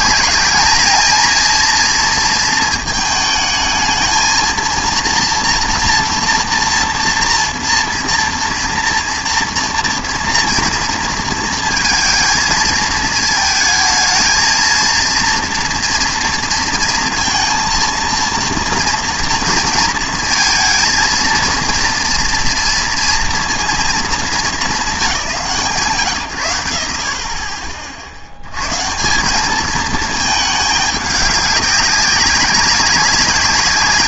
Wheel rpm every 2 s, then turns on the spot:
220, 220, 230, 240, 230, 230, 220, 220, 230, 230, 230, 230, 210, 100, 110, 210, 200.
none